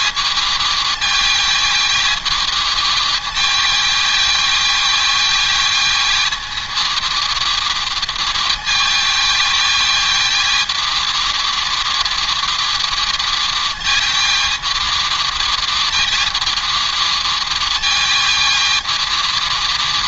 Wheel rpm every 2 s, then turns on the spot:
220, 220, 220, 230, 220, 220, 230, 220, 230, 220.
none